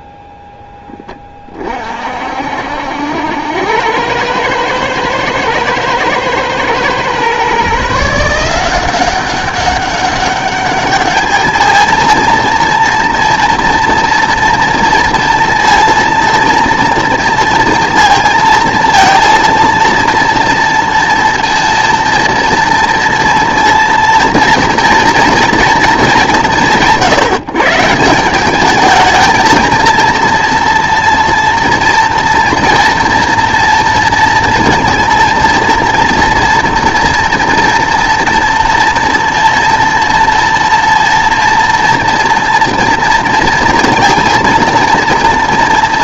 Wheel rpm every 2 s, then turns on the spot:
10, 60, 110, 120, 180, 200, 230, 230, 230, 230, 230, 230, 230, 160, 210, 230, 230, 230, 230, 230, 230, 230, 230.
none